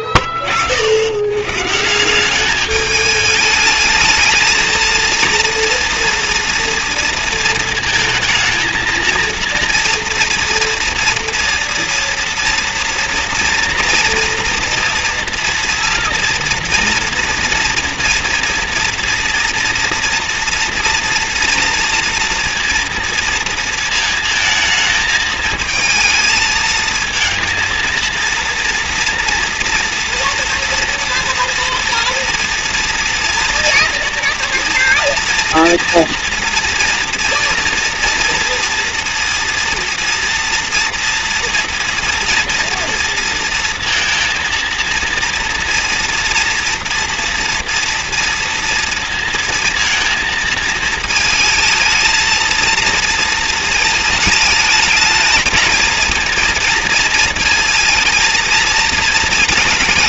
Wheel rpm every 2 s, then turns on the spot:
60, 200, 220, 230, 230, 230, 240, 230, 230, 230, 230, 230, 220, 220, 230, 240, 230, 230, 230, 230, 230, 230, 230, 230, 230, 220, 230, 220, 230, 230.
none